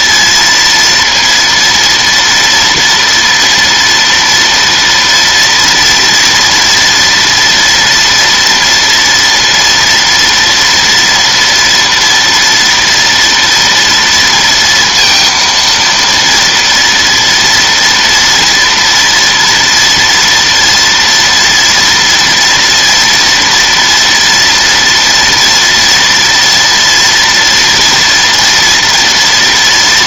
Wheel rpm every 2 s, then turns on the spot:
230, 230, 230, 230, 230, 230, 230, 230, 230, 230, 230, 230, 230, 230, 230.
none